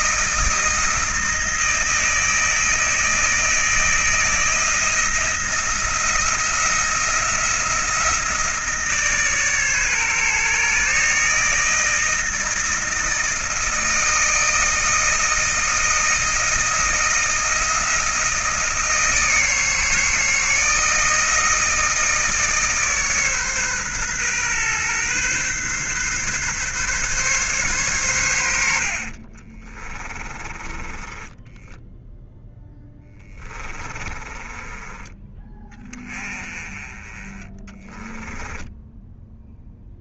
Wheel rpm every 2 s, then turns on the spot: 160, 160, 160, 170, 160, 150, 160, 160, 160, 160, 160, 150, 130, 140, 60, 20, 10, 20, 20, 10.
28-36 38-40